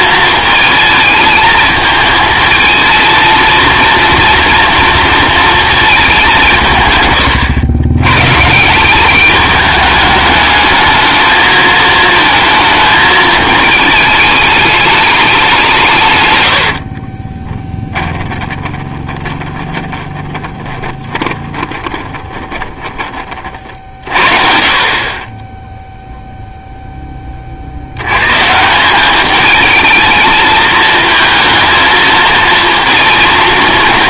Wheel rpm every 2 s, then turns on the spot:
220, 220, 230, 170, 160, 210, 220, 210, 70, 20, 10, 20, 40, 0, 160, 220, 230.
16-24